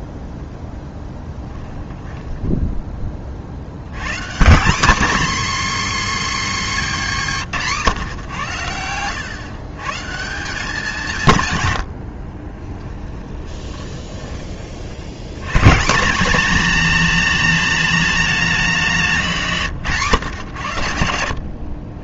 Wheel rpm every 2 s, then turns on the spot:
0, 20, 230, 240, 100, 170, 20, 60, 240, 200, 110.
8-10 12-14